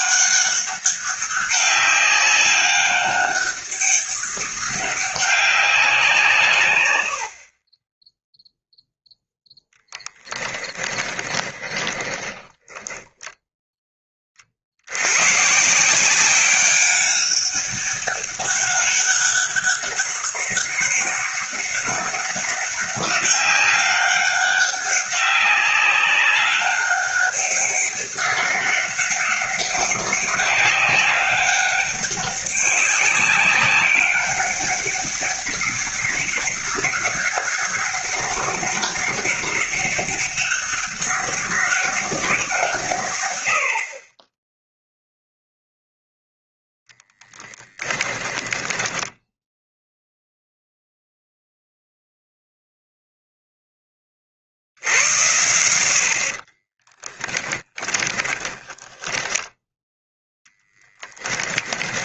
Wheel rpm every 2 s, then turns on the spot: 200, 200, 200, 120, 0, 10, 30, 60, 190, 200, 200, 200, 200, 200, 200, 200, 200, 200, 200, 200, 200, 150, 0, 0, 10, 0, 0, 80, 20, 20, 10.
10-14 48-50 56-62